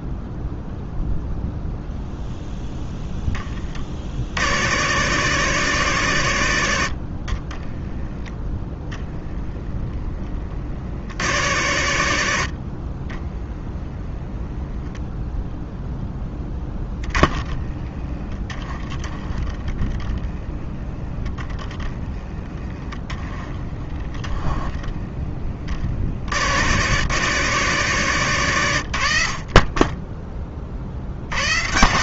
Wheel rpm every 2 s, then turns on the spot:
0, 0, 90, 100, 0, 50, 50, 0, 10, 10, 10, 20, 10, 90, 110, 30.
16-20 24-26